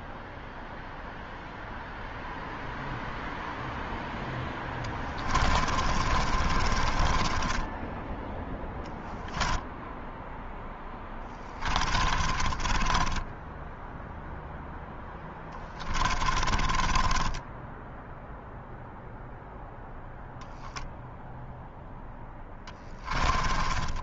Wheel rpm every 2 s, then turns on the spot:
0, 0, 20, 20, 0, 10, 10, 10, 20, 0, 0, 10.
4-8 10-18 22-24